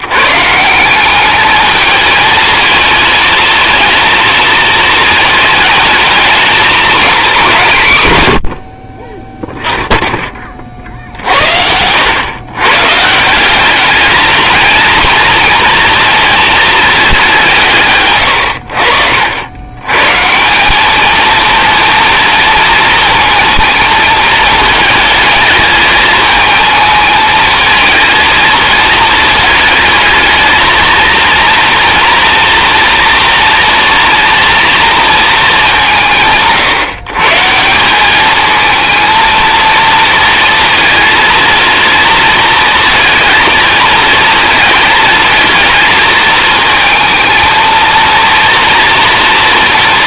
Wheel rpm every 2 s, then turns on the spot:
170, 220, 230, 230, 50, 40, 140, 220, 220, 70, 200, 230, 220, 220, 220, 220, 230, 230, 140, 220, 230, 230, 220, 220, 230.
none